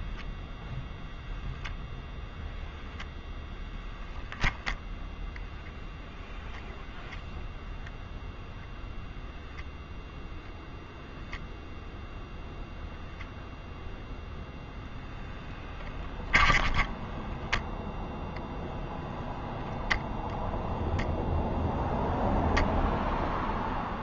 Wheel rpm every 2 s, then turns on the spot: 0, 0, 0, 0, 0, 0, 0, 0, 10, 0, 0, 0.
none